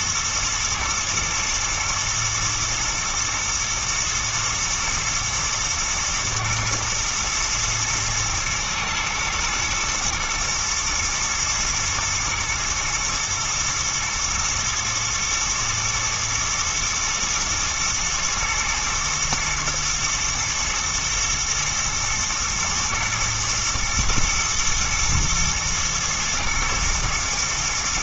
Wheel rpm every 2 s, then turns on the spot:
110, 110, 110, 110, 120, 110, 110, 110, 110, 110, 110, 120, 120, 120.
none